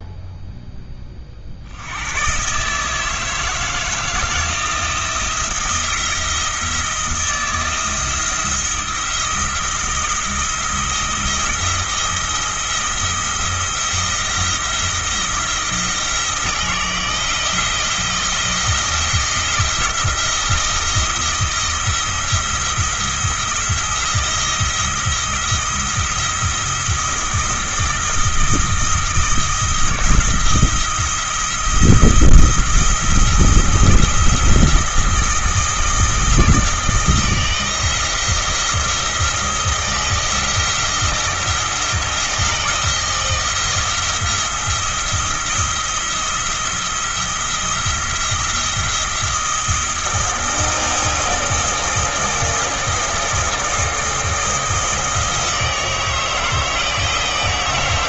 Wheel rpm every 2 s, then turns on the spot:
10, 150, 170, 170, 170, 170, 170, 160, 160, 170, 160, 170, 170, 170, 170, 170, 170, 170, 160, 170, 170, 170, 170, 170, 170, 170, 170, 160, 160.
none